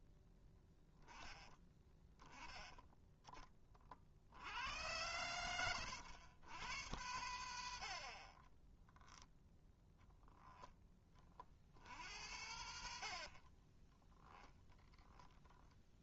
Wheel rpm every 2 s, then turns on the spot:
10, 20, 90, 100, 0, 20, 70, 10.
none